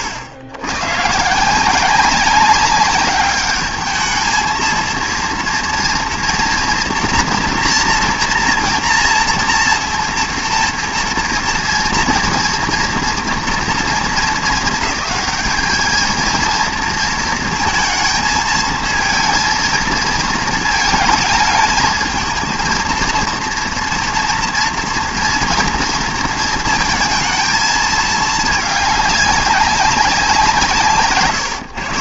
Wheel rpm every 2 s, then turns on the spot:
100, 200, 230, 230, 240, 230, 230, 210, 230, 220, 220, 240, 230, 230, 200, 150.
none